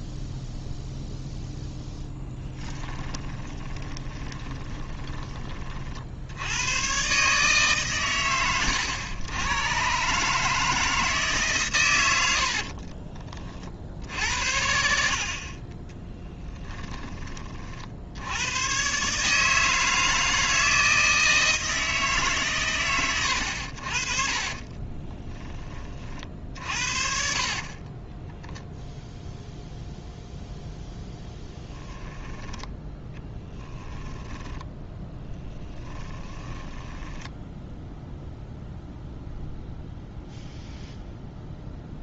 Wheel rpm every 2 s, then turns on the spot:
0, 10, 20, 90, 90, 160, 50, 70, 10, 120, 160, 120, 30, 50, 0, 0, 10, 10, 10, 0, 0.
2-6 12-14 16-18 24-28 32-38